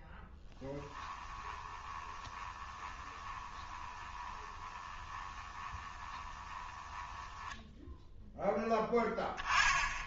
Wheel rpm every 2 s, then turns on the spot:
10, 20, 20, 10, 0.
0-8